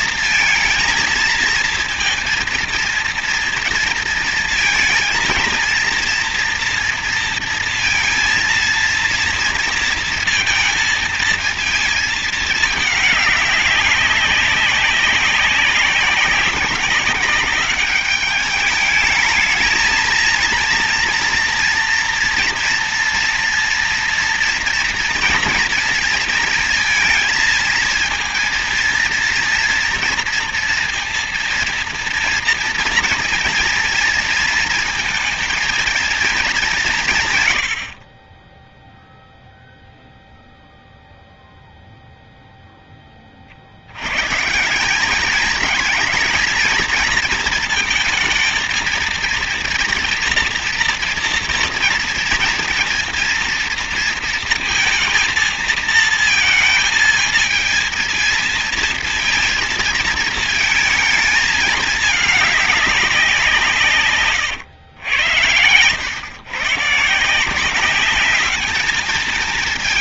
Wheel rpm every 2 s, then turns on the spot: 230, 230, 230, 230, 230, 230, 210, 200, 190, 210, 230, 230, 230, 230, 230, 240, 230, 230, 190, 10, 0, 10, 170, 220, 230, 240, 230, 230, 220, 230, 220, 210, 110, 140, 210.
38-40